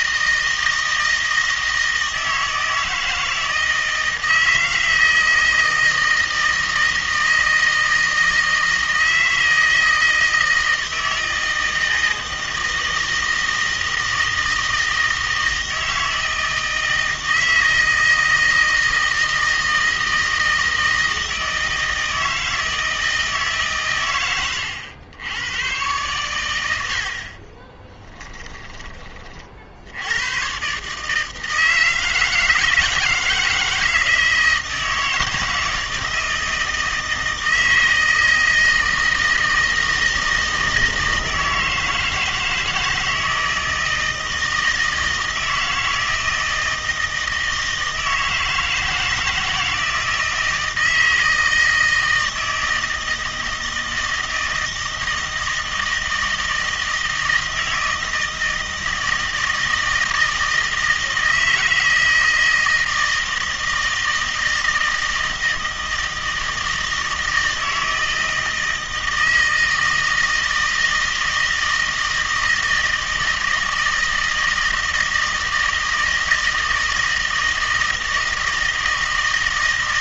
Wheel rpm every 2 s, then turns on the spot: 160, 160, 160, 160, 160, 160, 160, 160, 160, 160, 160, 160, 100, 90, 20, 140, 160, 160, 160, 160, 160, 160, 160, 160, 160, 160, 160, 160, 160, 160, 160, 160, 160, 160, 160, 160, 160, 160, 160, 160.
none